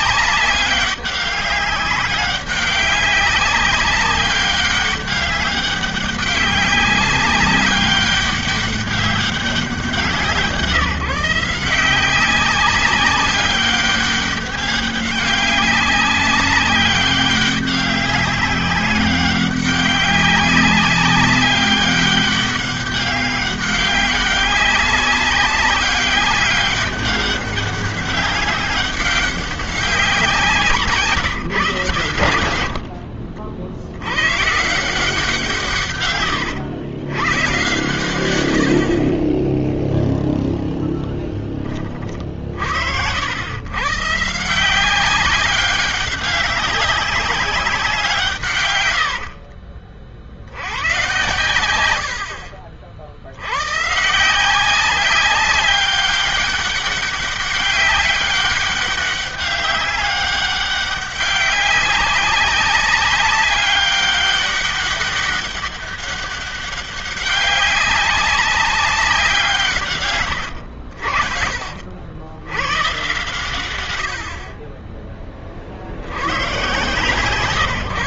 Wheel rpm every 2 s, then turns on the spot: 190, 200, 200, 200, 200, 170, 190, 200, 190, 200, 190, 200, 200, 200, 190, 170, 90, 120, 110, 100, 0, 50, 150, 200, 140, 60, 60, 160, 200, 200, 200, 200, 200, 200, 190, 100, 100, 50, 100.
52-54 70-72